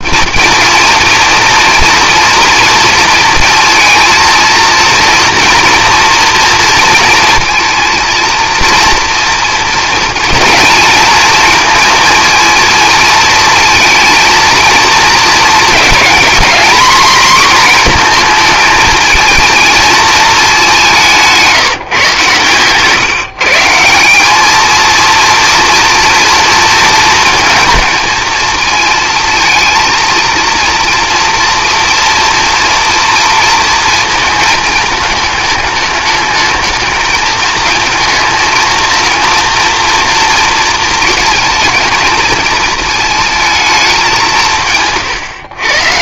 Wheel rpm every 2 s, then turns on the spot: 230, 230, 230, 230, 230, 230, 230, 230, 240, 220, 190, 140, 230, 230, 220, 230, 230, 220, 220, 230, 230, 220, 130.
none